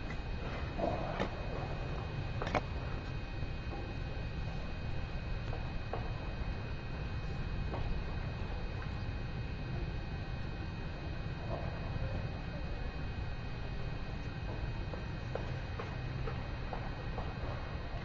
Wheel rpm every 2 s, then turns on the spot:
0, 0, 0, 0, 0, 0, 0, 0, 0.
none